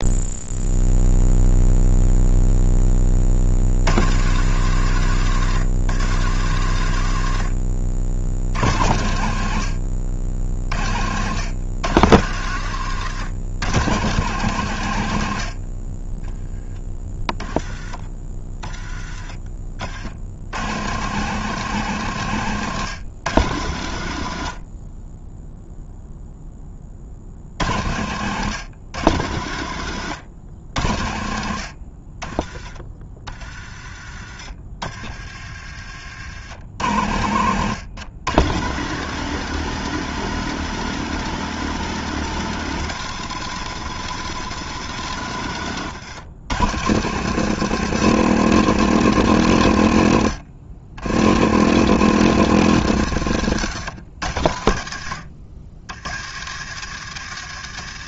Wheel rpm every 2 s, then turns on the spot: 0, 30, 110, 80, 50, 80, 110, 80, 20, 30, 130, 120, 20, 50, 110, 70, 30, 40, 80, 130, 140, 140, 120, 120, 130, 90, 110, 60, 100.
34-36